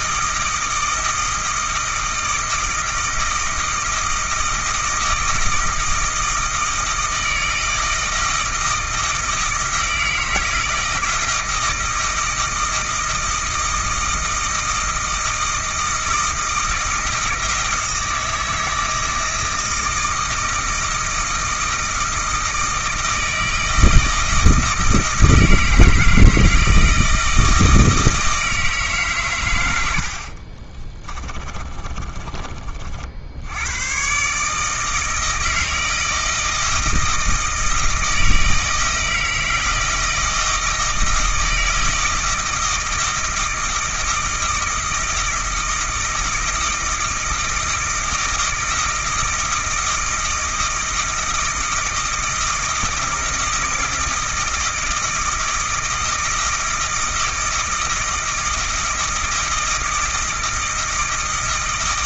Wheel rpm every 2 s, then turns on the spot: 160, 160, 160, 160, 160, 160, 160, 160, 160, 160, 160, 160, 160, 160, 160, 40, 30, 150, 160, 160, 160, 160, 160, 160, 160, 160, 160, 160, 160, 160, 160.
30-32